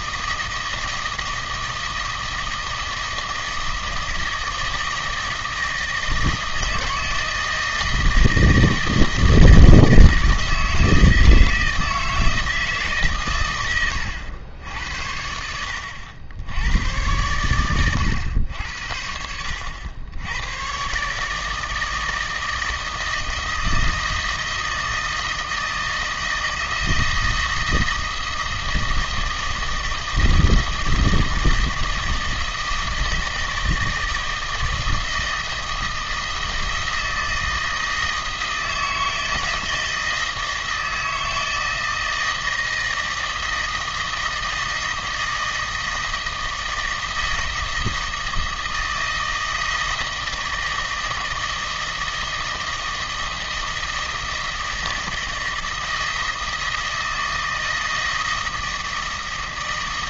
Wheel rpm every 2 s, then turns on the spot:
160, 160, 160, 160, 160, 160, 160, 80, 90, 80, 120, 160, 160, 160, 160, 160, 160, 160, 160, 160, 160, 160, 160, 160, 160, 160, 160, 160, 160, 160.
none